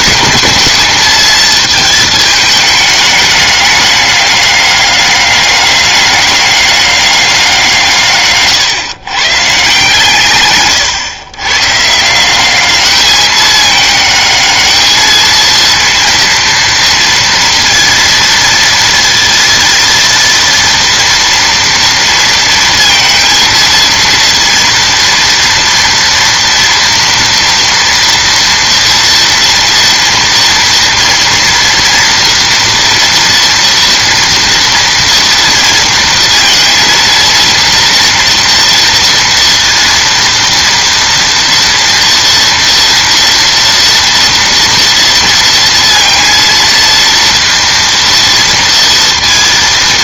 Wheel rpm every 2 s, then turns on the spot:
210, 210, 200, 200, 130, 120, 200, 220, 230, 230, 230, 230, 230, 240, 230, 230, 230, 230, 230, 230, 230, 230, 230, 230, 230.
none